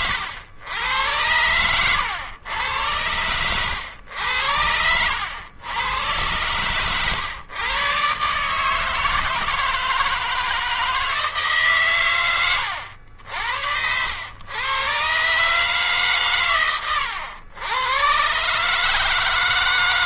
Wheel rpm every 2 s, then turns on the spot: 110, 110, 90, 130, 160, 160, 90, 130, 110, 150.
none